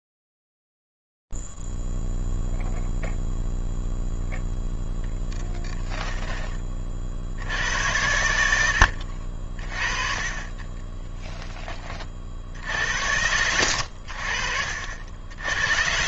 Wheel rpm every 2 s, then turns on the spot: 0, 0, 0, 10, 90, 40, 40, 70.
none